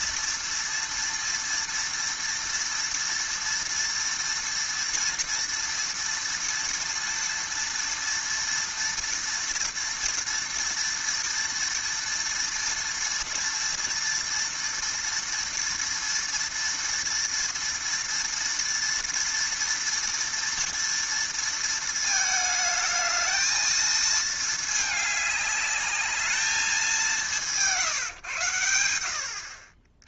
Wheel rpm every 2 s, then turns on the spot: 230, 230, 230, 230, 230, 230, 230, 230, 230, 230, 230, 220, 210, 200, 100.
none